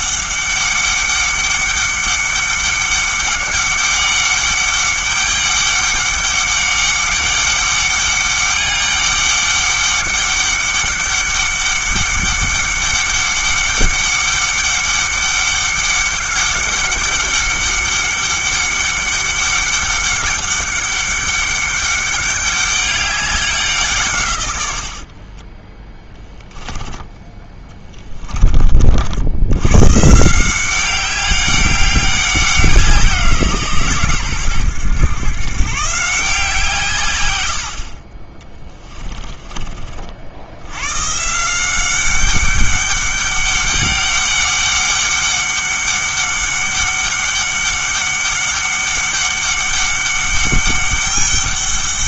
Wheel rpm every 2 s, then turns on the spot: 200, 200, 200, 200, 200, 200, 200, 200, 200, 200, 200, 200, 80, 10, 60, 190, 180, 120, 150, 30, 110, 200, 200, 200, 200, 200.
38-40